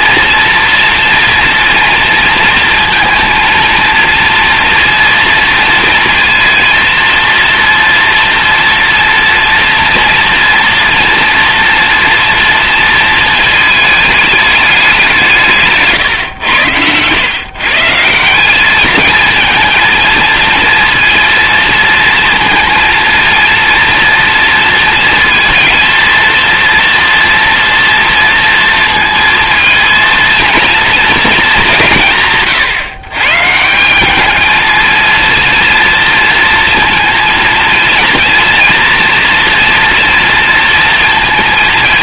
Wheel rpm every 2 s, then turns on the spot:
230, 230, 230, 230, 240, 230, 230, 200, 110, 210, 230, 230, 230, 230, 230, 230, 140, 220, 230, 230, 230.
16-18